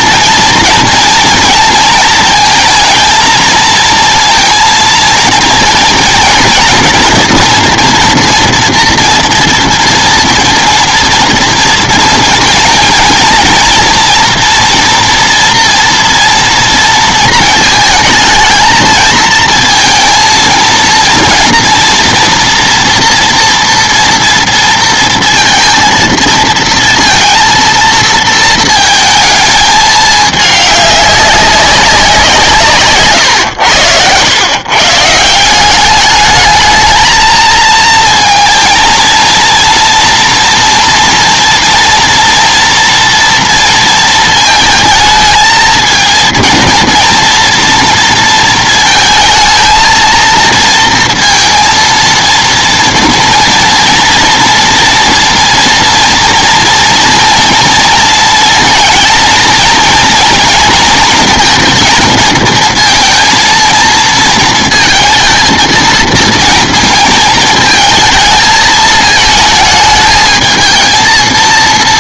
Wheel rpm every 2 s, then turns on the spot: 240, 230, 230, 230, 230, 230, 230, 240, 230, 220, 230, 230, 230, 230, 230, 200, 150, 140, 220, 230, 240, 230, 220, 230, 220, 230, 240, 230, 240, 230, 230, 230, 230, 230, 220, 220.
none